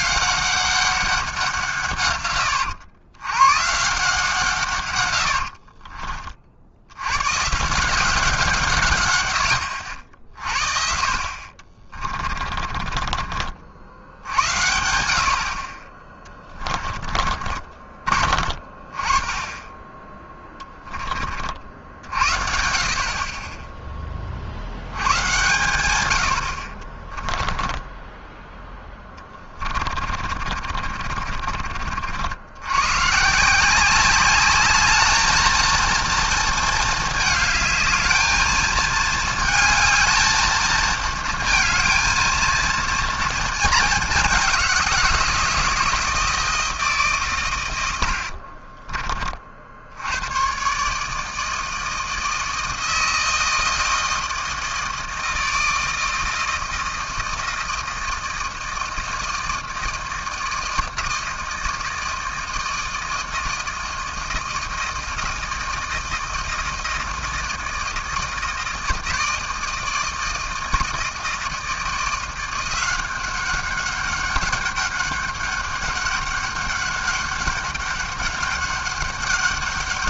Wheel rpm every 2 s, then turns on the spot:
180, 120, 90, 120, 100, 50, 40, 60, 40, 30, 30, 30, 120, 20, 20, 60, 150, 220, 210, 220, 230, 230, 170, 140, 30, 150, 160, 160, 160, 160, 160, 160, 160, 160, 160, 160, 190, 200, 200, 200.
4-6 10-12 16-18 26-32